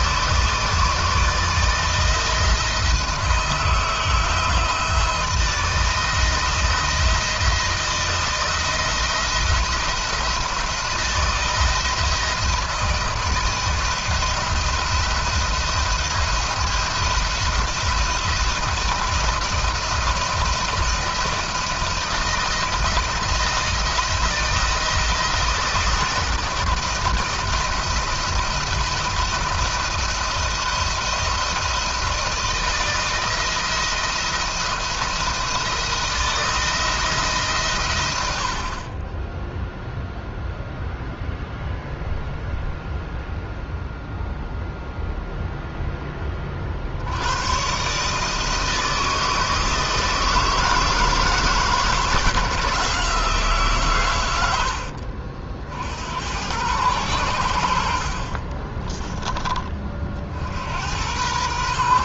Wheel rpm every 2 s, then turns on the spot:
160, 160, 160, 160, 170, 170, 160, 170, 170, 170, 170, 170, 170, 160, 170, 170, 160, 170, 160, 50, 0, 0, 0, 40, 160, 160, 160, 80, 100, 30, 70.
58-60